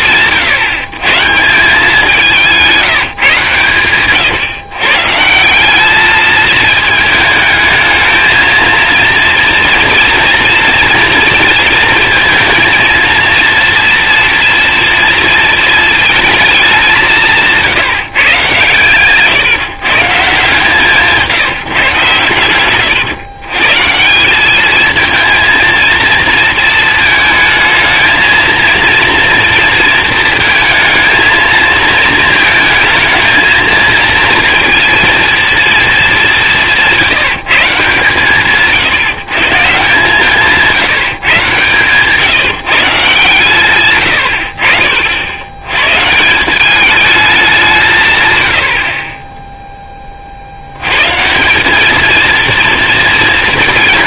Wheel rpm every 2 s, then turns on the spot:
130, 150, 150, 220, 230, 230, 230, 230, 170, 140, 160, 120, 230, 220, 230, 220, 220, 230, 170, 150, 150, 140, 80, 210, 30, 140, 220.
none